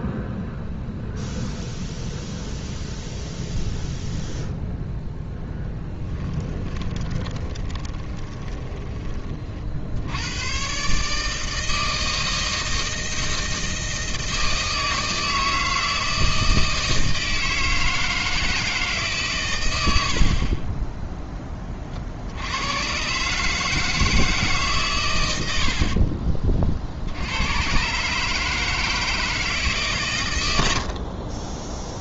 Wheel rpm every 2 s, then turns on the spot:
0, 0, 0, 20, 20, 120, 160, 160, 160, 160, 30, 90, 140, 40, 150, 90.
6-10